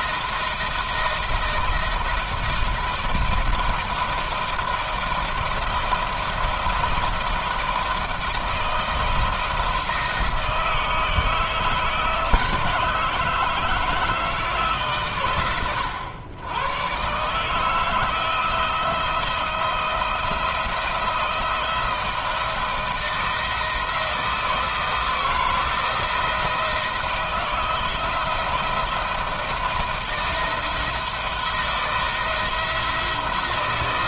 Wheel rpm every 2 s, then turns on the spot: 160, 160, 170, 160, 160, 160, 150, 140, 120, 160, 170, 160, 160, 160, 160, 170, 170.
none